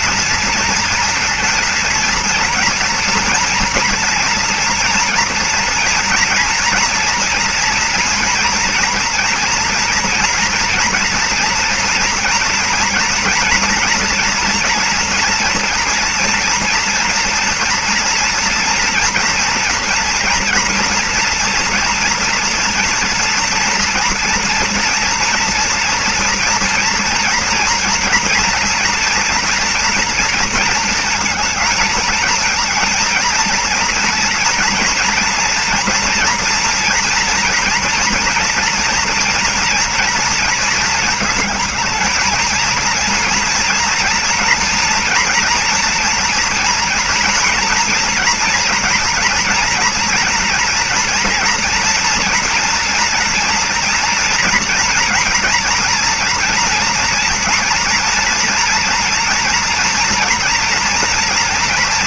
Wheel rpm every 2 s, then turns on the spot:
230, 230, 230, 230, 230, 230, 230, 240, 230, 230, 240, 240, 230, 230, 230, 230, 230, 230, 230, 230, 230, 220, 230, 230, 230, 230, 230, 230, 230, 230, 230.
none